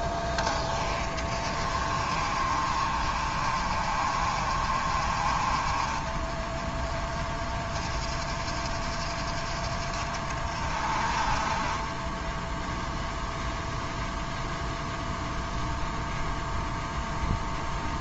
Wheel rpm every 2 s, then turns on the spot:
20, 60, 60, 30, 50, 40, 10, 0, 0.
6-8